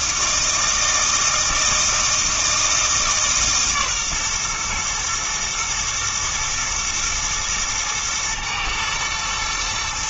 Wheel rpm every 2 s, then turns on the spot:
160, 160, 120, 110, 120.
none